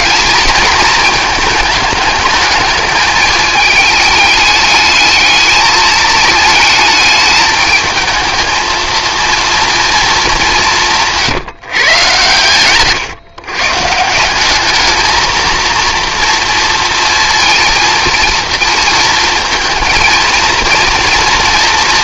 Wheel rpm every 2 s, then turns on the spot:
230, 210, 210, 210, 220, 180, 120, 200, 230, 230, 230.
none